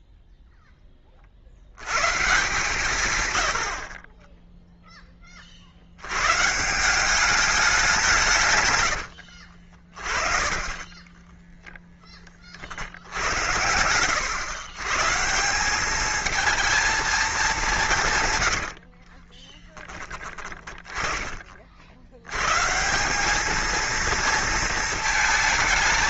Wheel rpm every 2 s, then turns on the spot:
10, 130, 10, 160, 110, 20, 40, 110, 220, 70, 20, 150, 220.
8-10 18-22